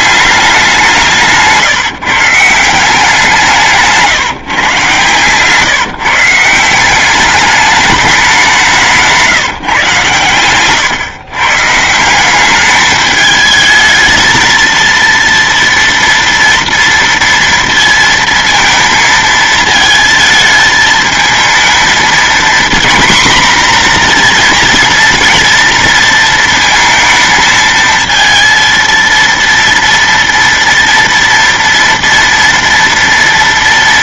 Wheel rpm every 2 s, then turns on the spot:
180, 170, 130, 190, 170, 110, 210, 230, 230, 220, 220, 240, 230, 230, 230, 230, 230.
none